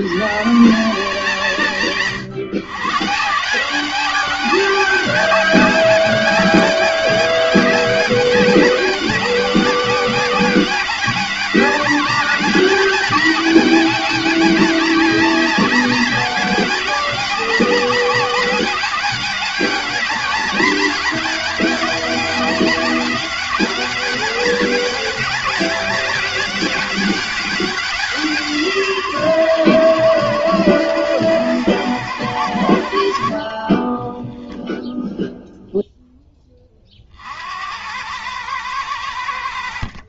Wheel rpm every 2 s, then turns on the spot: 160, 140, 200, 200, 200, 200, 210, 200, 190, 200, 200, 190, 200, 200, 150, 120, 80, 0, 40, 100.
none